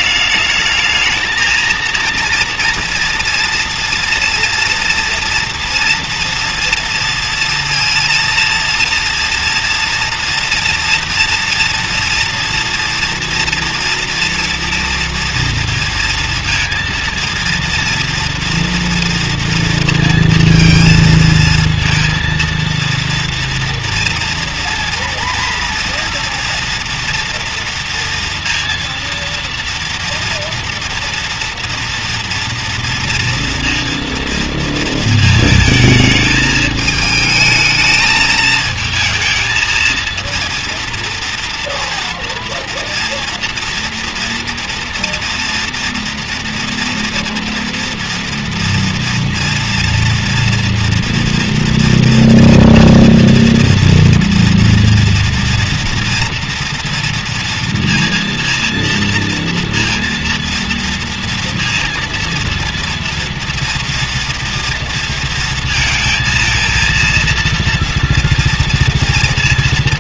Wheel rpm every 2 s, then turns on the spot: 210, 230, 230, 230, 230, 240, 230, 230, 230, 230, 230, 230, 230, 230, 230, 230, 230, 230, 220, 220, 230, 230, 230, 230, 230, 230, 230, 230, 230, 230, 230, 230, 240, 230, 230.
none